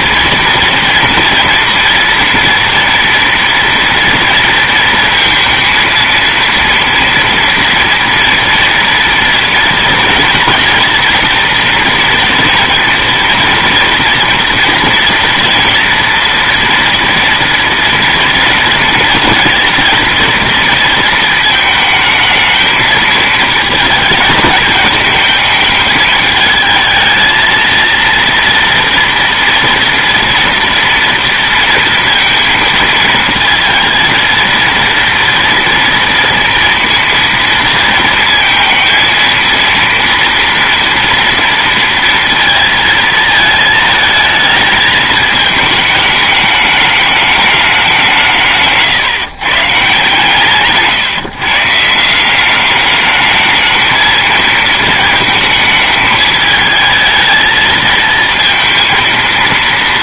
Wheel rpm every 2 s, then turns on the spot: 230, 230, 230, 230, 240, 240, 230, 230, 230, 230, 230, 220, 210, 220, 230, 230, 230, 230, 230, 230, 230, 230, 220, 210, 150, 150, 200, 230, 220, 230.
none